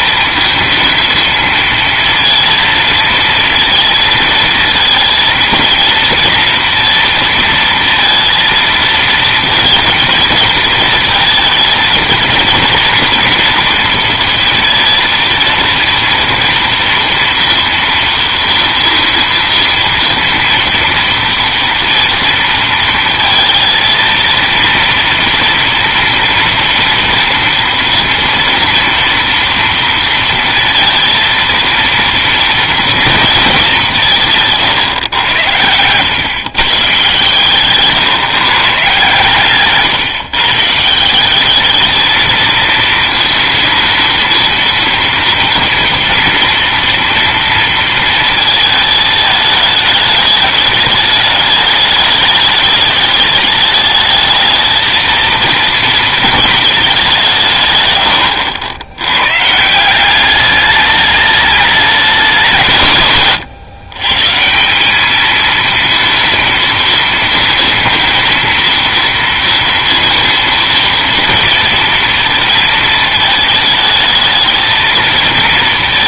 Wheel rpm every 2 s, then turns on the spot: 220, 230, 230, 230, 230, 220, 230, 230, 240, 230, 230, 230, 230, 230, 240, 230, 230, 150, 130, 130, 140, 220, 230, 230, 220, 210, 210, 220, 220, 80, 200, 160, 160, 230, 230, 230, 230, 220.
none